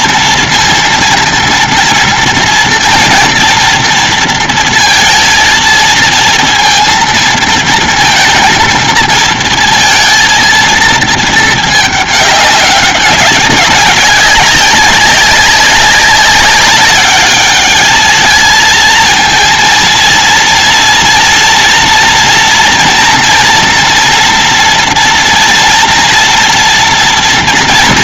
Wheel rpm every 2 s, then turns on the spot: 230, 230, 230, 230, 230, 230, 210, 200, 200, 220, 230, 230, 230, 230.
none